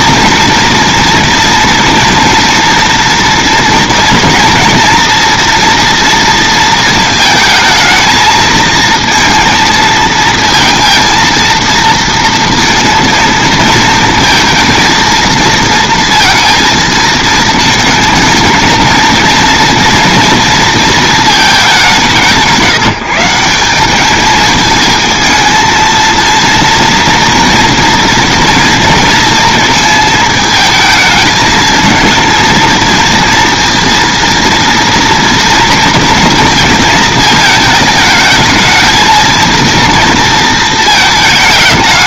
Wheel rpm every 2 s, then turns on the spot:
230, 240, 230, 230, 230, 230, 230, 230, 230, 230, 230, 170, 220, 230, 230, 220, 230, 230, 230, 220, 220.
none